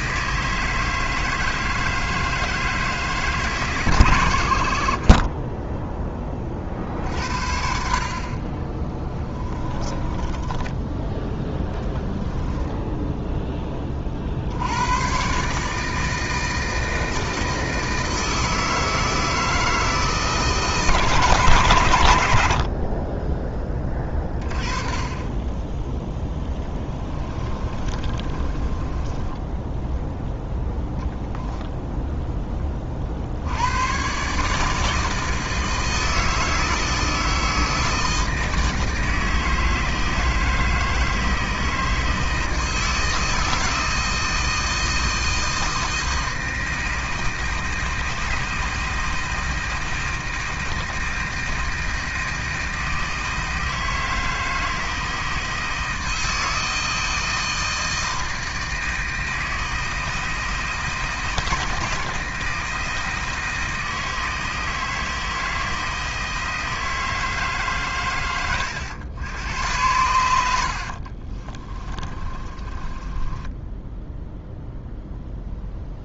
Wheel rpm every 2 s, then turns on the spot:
160, 160, 50, 50, 20, 10, 10, 100, 160, 160, 150, 40, 20, 20, 20, 0, 30, 160, 160, 160, 160, 160, 160, 160, 160, 160, 160, 160, 160, 160, 160, 160, 160, 160, 100, 60, 20, 0.
10-14 26-30 70-72